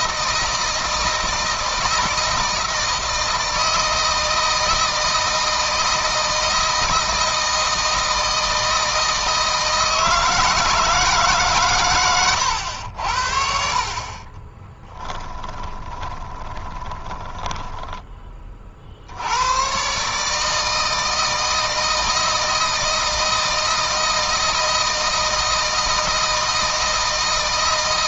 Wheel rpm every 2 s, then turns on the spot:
160, 160, 170, 160, 160, 160, 80, 20, 20, 50, 160, 160, 160, 160.
14-18